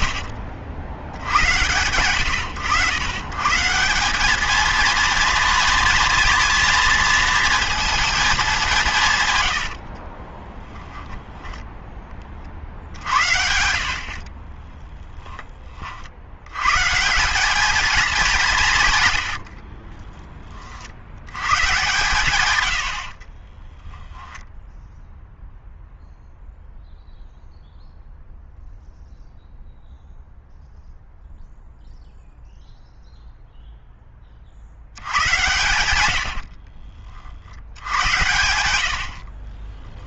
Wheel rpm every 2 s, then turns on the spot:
90, 100, 220, 230, 190, 10, 60, 20, 100, 170, 40, 110, 0, 0, 0, 0, 0, 70, 60, 90.
10-12 14-16 22-24 36-38